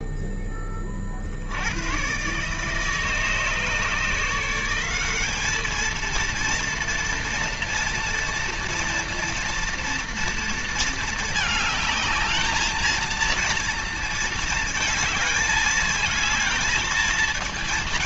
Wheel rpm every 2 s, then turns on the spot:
20, 150, 170, 230, 230, 230, 220, 220, 220.
none